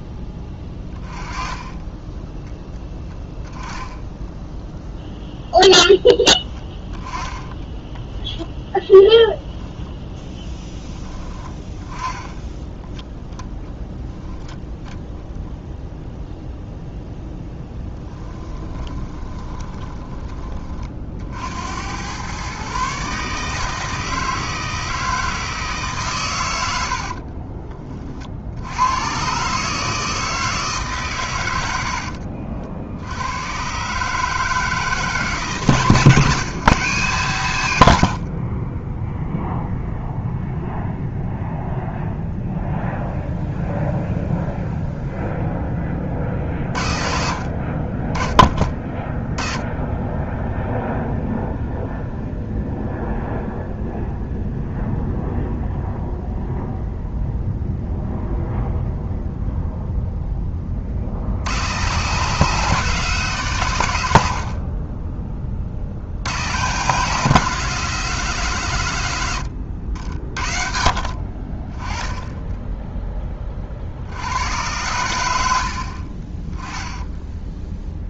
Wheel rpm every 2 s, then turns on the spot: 20, 10, 0, 10, 10, 10, 10, 20, 0, 20, 40, 140, 160, 70, 100, 140, 70, 160, 150, 20, 0, 0, 0, 50, 20, 0, 0, 0, 0, 0, 40, 170, 30, 140, 120, 40, 10, 100, 10.
18-20 26-28